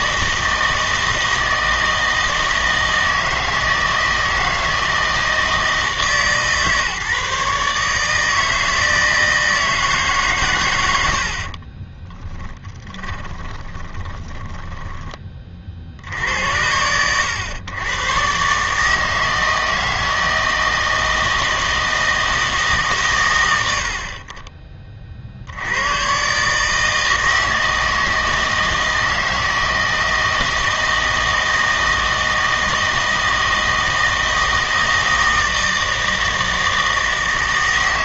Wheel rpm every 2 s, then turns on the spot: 160, 160, 160, 150, 160, 120, 20, 20, 90, 140, 160, 160, 30, 150, 160, 160, 160, 160, 160.
12-16